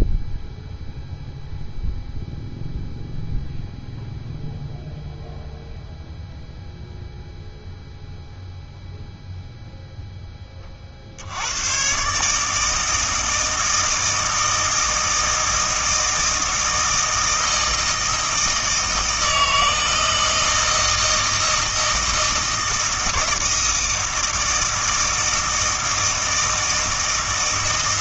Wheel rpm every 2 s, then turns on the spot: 0, 0, 0, 0, 0, 30, 160, 160, 160, 160, 160, 160, 160, 160.
none